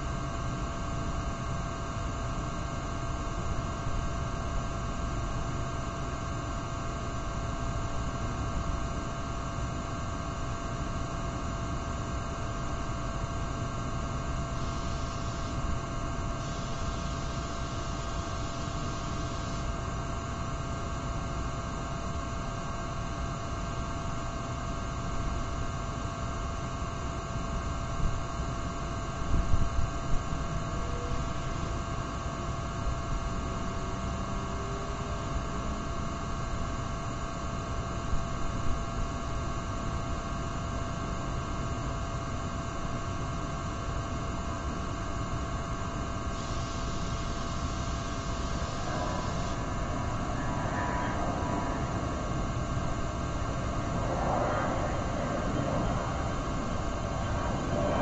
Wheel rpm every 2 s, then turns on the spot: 0, 0, 0, 0, 0, 0, 0, 0, 0, 0, 0, 0, 0, 0, 0, 0, 0, 0, 0, 0, 0, 0, 0, 0, 0, 0, 0, 0, 0.
none